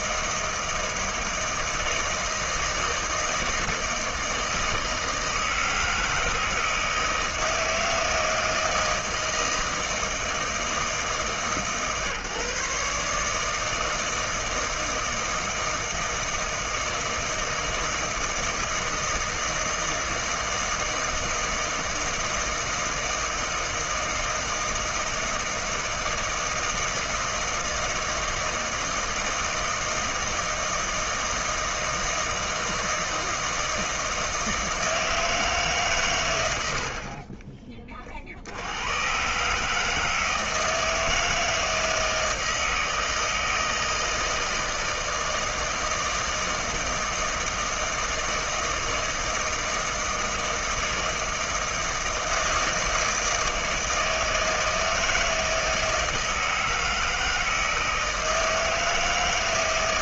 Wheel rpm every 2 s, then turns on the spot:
160, 160, 160, 160, 160, 160, 150, 160, 160, 160, 160, 160, 160, 160, 160, 160, 160, 160, 70, 90, 160, 160, 160, 160, 160, 160, 160, 160, 160, 160.
36-38